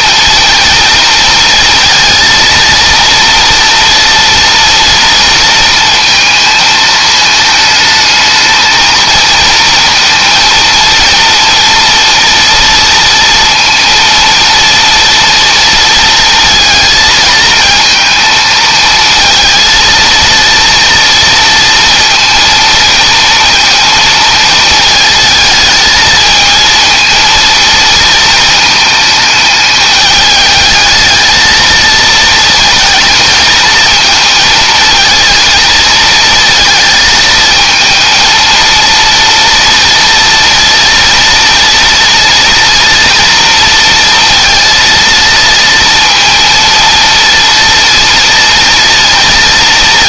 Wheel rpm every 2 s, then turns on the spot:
230, 230, 230, 220, 230, 230, 230, 230, 230, 220, 230, 230, 220, 230, 220, 220, 230, 230, 220, 230, 230, 230, 230, 230, 230.
none